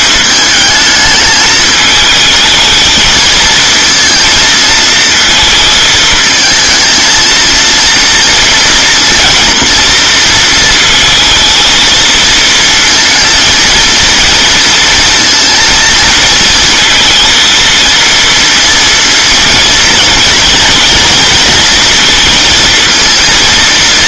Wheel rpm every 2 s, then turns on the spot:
210, 220, 230, 230, 230, 230, 230, 230, 220, 230, 230, 230.
none